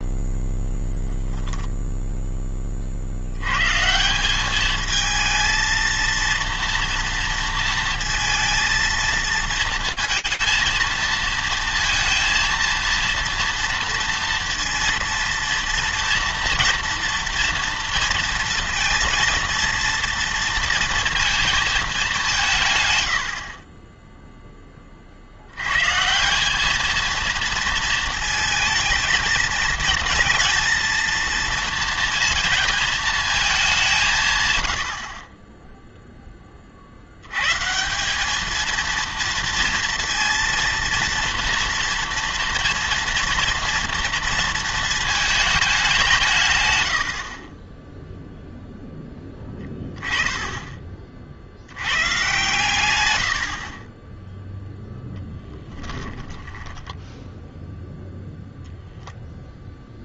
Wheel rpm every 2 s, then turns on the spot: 0, 10, 200, 230, 230, 230, 230, 230, 240, 230, 230, 130, 10, 200, 220, 230, 230, 110, 20, 210, 230, 230, 230, 140, 0, 10, 120, 0, 20, 0.
56-58